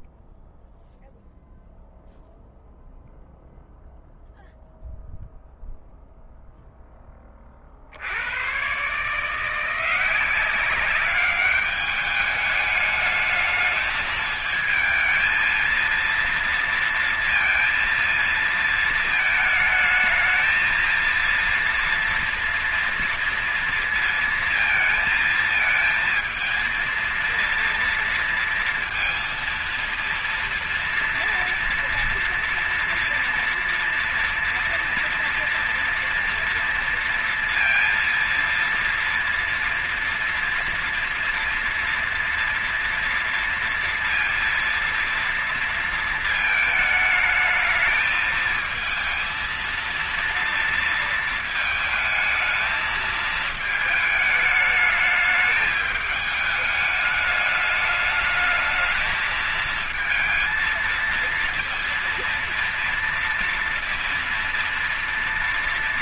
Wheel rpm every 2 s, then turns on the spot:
0, 0, 0, 0, 120, 190, 210, 220, 230, 220, 230, 230, 220, 230, 230, 230, 230, 230, 230, 230, 230, 230, 230, 220, 220, 230, 220, 210, 210, 220, 230, 230, 230.
none